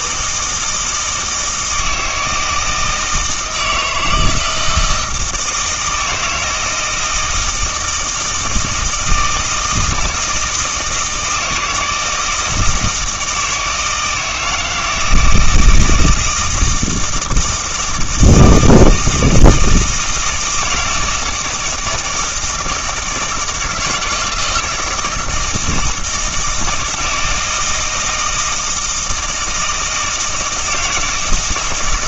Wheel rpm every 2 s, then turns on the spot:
160, 160, 160, 170, 160, 160, 160, 160, 160, 160, 160, 160, 170, 160, 160, 160.
none